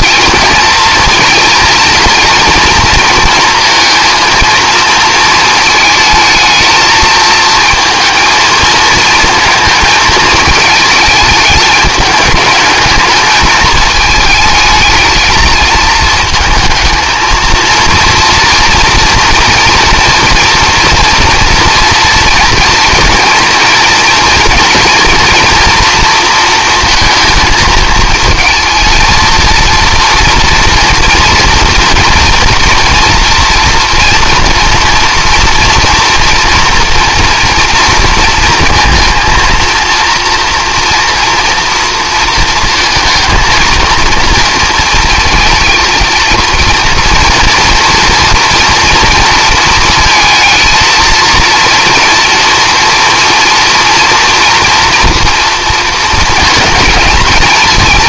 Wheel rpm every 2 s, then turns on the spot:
230, 230, 230, 220, 220, 220, 210, 220, 220, 230, 240, 230, 230, 230, 220, 240, 230, 230, 230, 220, 230, 230, 230, 230, 230, 220, 230, 230, 220.
none